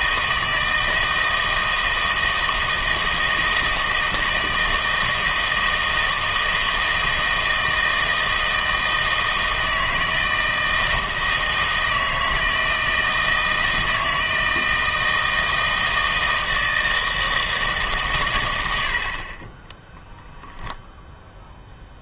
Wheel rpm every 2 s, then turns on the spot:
160, 160, 160, 160, 160, 160, 160, 160, 160, 90, 0.
none